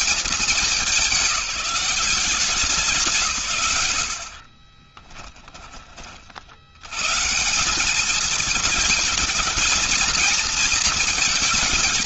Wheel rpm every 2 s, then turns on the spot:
210, 180, 40, 110, 220, 220.
4-6